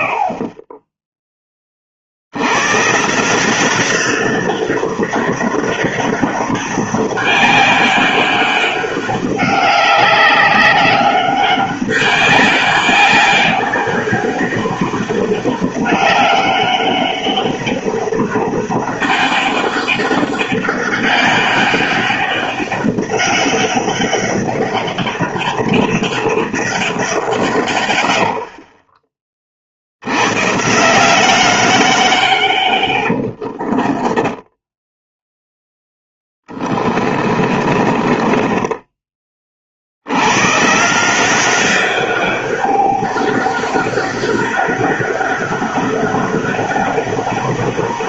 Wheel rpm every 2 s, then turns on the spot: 20, 130, 200, 190, 200, 200, 200, 200, 200, 200, 200, 200, 200, 190, 40, 160, 110, 10, 30, 20, 150, 200, 200, 200.
28-30 32-40